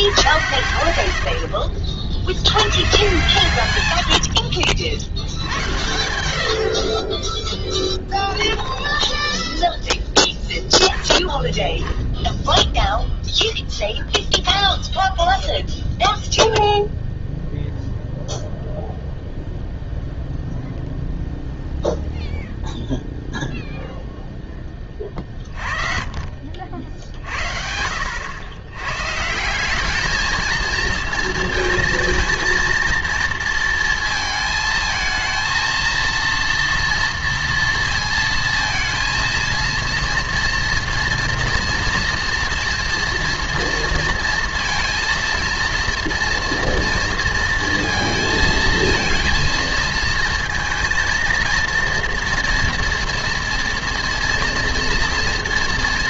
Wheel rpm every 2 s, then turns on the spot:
100, 90, 70, 70, 20, 10, 0, 0, 0, 0, 0, 0, 10, 50, 100, 220, 230, 220, 230, 230, 230, 230, 230, 230, 230, 230, 230, 230.
4-6 8-10